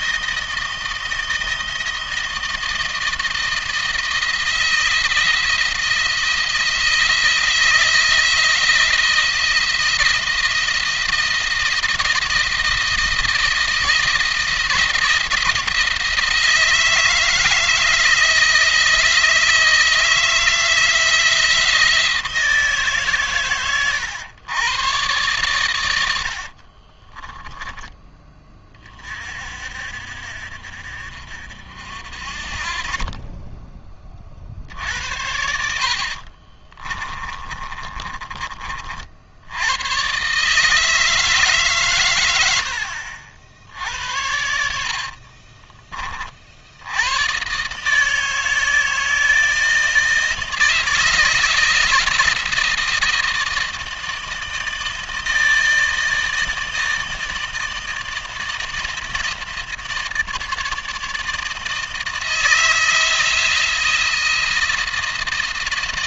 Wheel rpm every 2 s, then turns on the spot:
160, 160, 170, 170, 170, 170, 160, 170, 160, 160, 160, 150, 110, 50, 30, 50, 40, 50, 30, 40, 140, 70, 70, 80, 160, 160, 160, 160, 160, 160, 150, 160, 170.
26-28 36-38 44-46